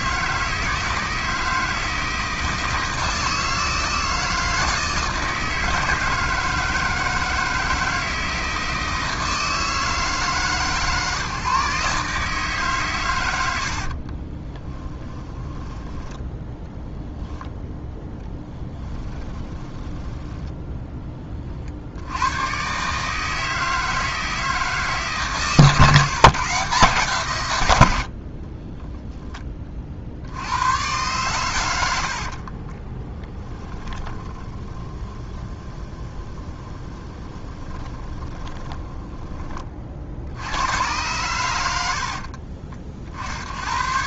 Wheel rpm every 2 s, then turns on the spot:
160, 160, 160, 160, 160, 140, 130, 20, 0, 10, 10, 130, 150, 140, 10, 100, 20, 20, 20, 10, 110, 50.
14-16 18-20 28-30 32-40